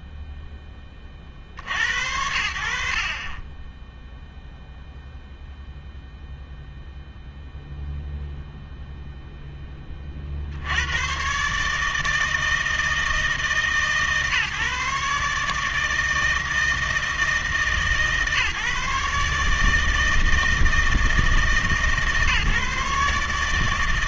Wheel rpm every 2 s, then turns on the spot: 20, 50, 0, 0, 0, 100, 160, 140, 160, 150, 160, 140.
none